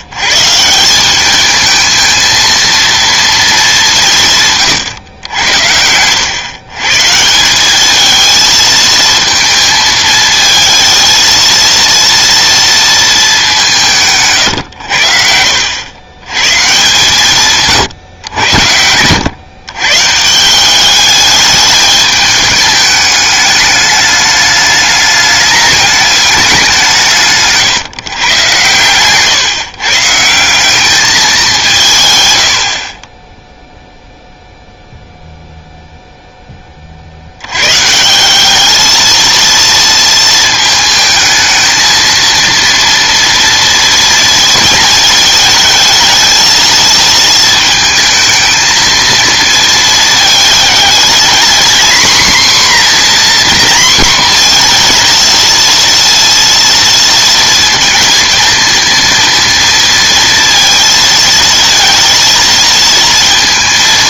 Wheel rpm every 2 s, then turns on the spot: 150, 230, 140, 120, 220, 220, 230, 130, 130, 90, 180, 220, 210, 200, 120, 170, 70, 0, 10, 200, 220, 230, 230, 220, 220, 220, 250, 240, 230, 220, 230, 230.
4-6 14-16